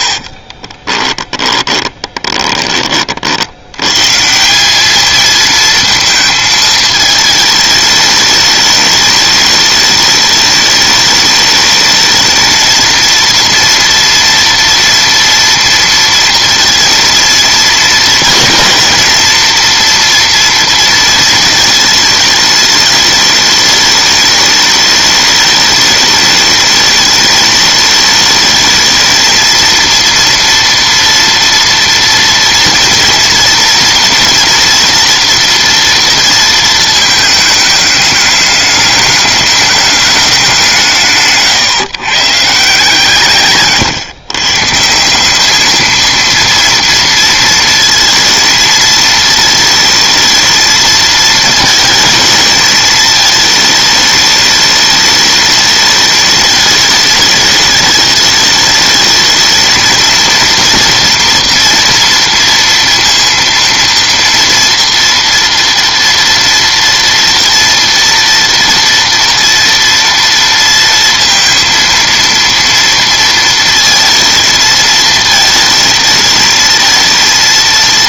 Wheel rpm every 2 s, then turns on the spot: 30, 20, 180, 220, 210, 210, 230, 230, 230, 230, 230, 210, 210, 210, 220, 230, 230, 230, 220, 210, 170, 150, 150, 230, 220, 220, 220, 210, 210, 220, 230, 230, 230, 230, 230, 230, 230, 230, 220.
0-2